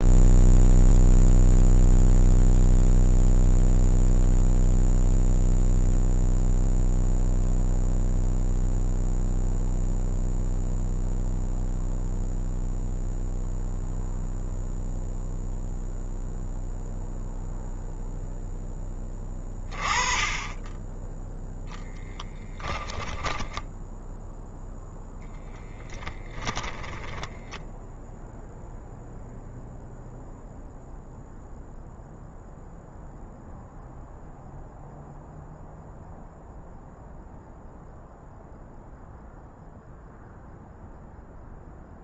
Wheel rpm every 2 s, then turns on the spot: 0, 0, 0, 0, 0, 0, 0, 0, 0, 10, 10, 0, 0, 10, 0, 0, 0, 0, 0, 0, 0.
26-28